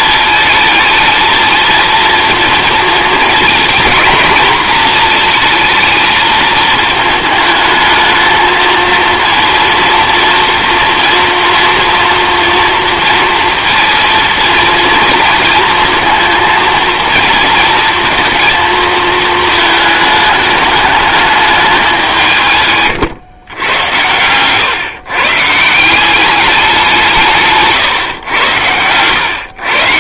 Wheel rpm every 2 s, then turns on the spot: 220, 230, 230, 220, 220, 230, 230, 230, 220, 230, 220, 140, 120, 190, 110.
none